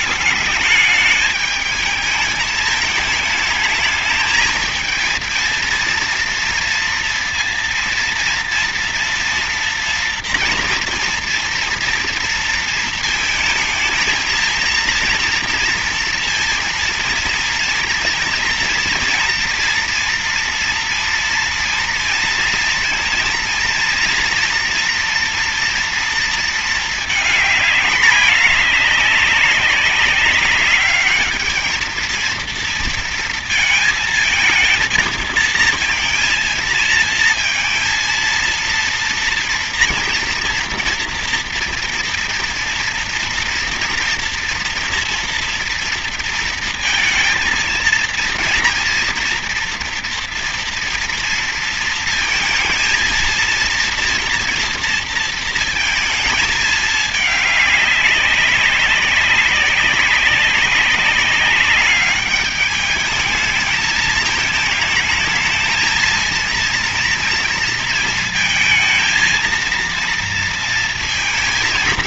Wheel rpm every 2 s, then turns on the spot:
210, 220, 220, 230, 230, 230, 230, 230, 230, 230, 230, 230, 240, 230, 210, 200, 230, 220, 230, 230, 240, 230, 240, 230, 230, 240, 230, 230, 220, 190, 200, 210, 220, 230, 220, 230.
none